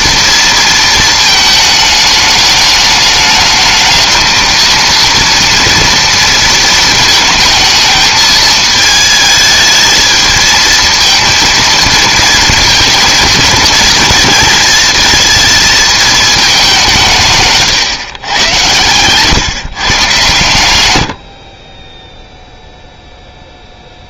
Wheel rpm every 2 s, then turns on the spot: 230, 210, 230, 230, 220, 220, 230, 230, 200, 110, 110, 0.
none